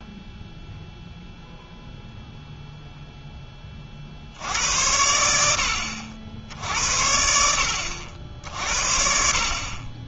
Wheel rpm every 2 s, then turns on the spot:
0, 0, 80, 70, 60.
none